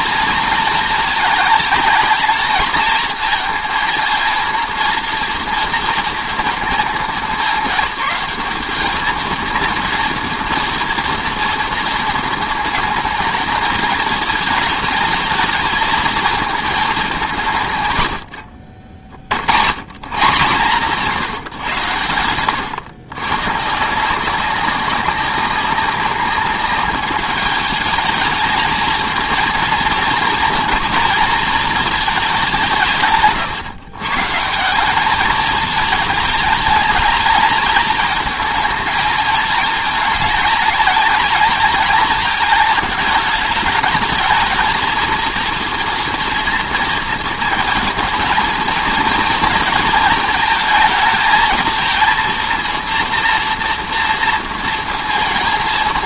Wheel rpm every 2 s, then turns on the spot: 220, 230, 230, 200, 230, 230, 230, 210, 190, 60, 150, 120, 190, 200, 230, 230, 140, 210, 220, 220, 220, 210, 220, 220, 230, 220, 230, 230.
none